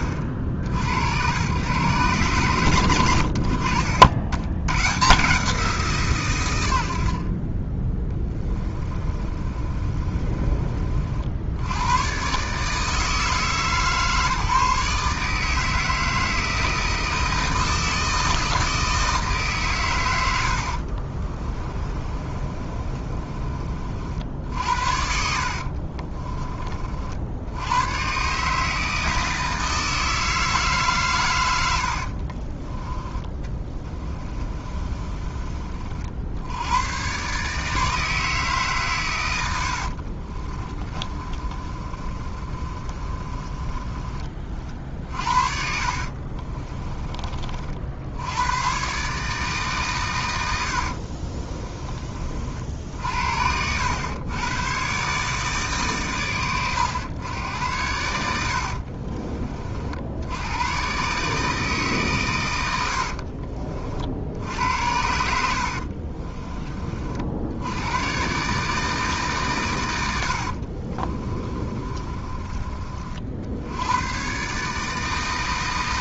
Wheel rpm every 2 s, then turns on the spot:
60, 110, 130, 30, 20, 50, 150, 150, 160, 160, 60, 30, 70, 50, 160, 140, 30, 30, 110, 130, 30, 30, 50, 30, 120, 70, 60, 130, 110, 50, 120, 90, 80, 40, 150, 50, 30, 150.
8-10 20-26 34-36 40-44 46-48 50-52 58-60 70-72